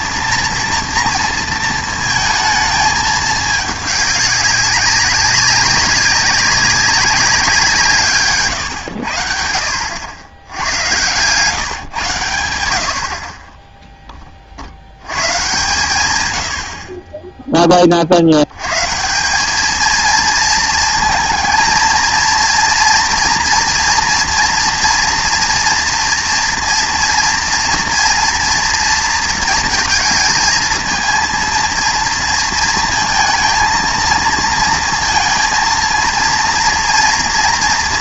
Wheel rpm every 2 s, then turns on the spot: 240, 220, 200, 200, 110, 110, 90, 50, 80, 110, 230, 230, 230, 230, 230, 220, 230, 230, 230.
none